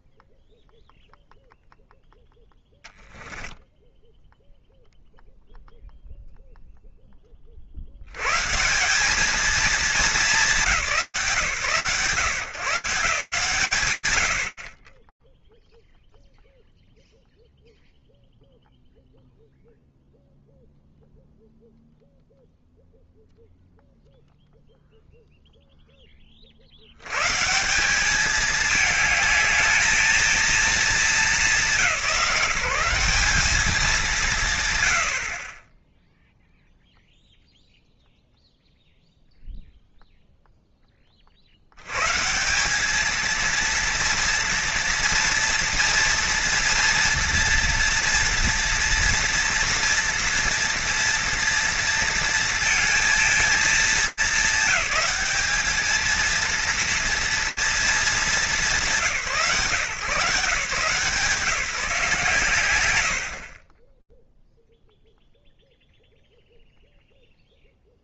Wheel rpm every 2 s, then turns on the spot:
0, 10, 0, 30, 220, 160, 130, 30, 0, 0, 0, 0, 0, 160, 220, 190, 200, 40, 0, 0, 50, 230, 230, 230, 230, 230, 230, 210, 230, 150, 160, 60, 0, 0.
2-4